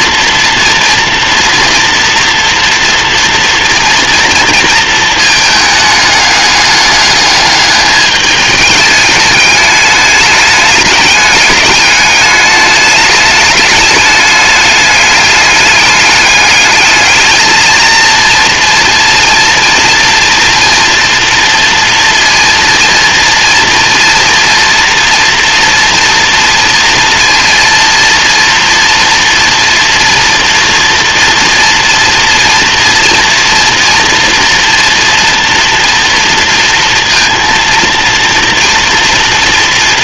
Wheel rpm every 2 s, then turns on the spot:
230, 230, 230, 210, 210, 200, 210, 210, 220, 230, 240, 230, 240, 230, 230, 230, 230, 230, 230, 230.
none